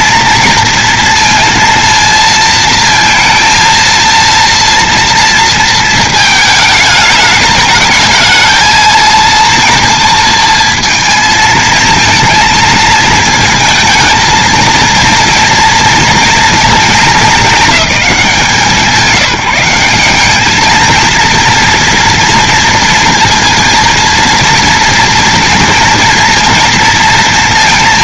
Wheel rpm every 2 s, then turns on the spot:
230, 230, 230, 220, 220, 230, 220, 220, 230, 190, 200, 230, 230, 230.
none